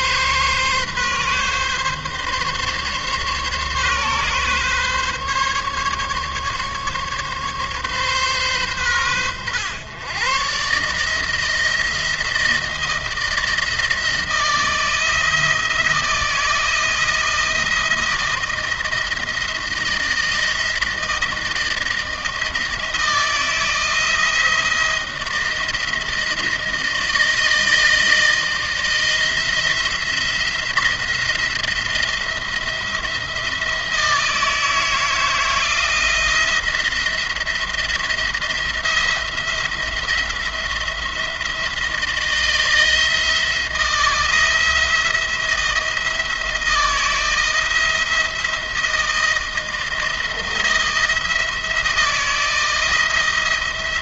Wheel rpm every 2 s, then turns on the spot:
140, 140, 140, 140, 120, 150, 170, 160, 170, 160, 160, 160, 160, 160, 160, 170, 170, 160, 170, 170, 170, 170, 170, 170, 170, 170, 170.
none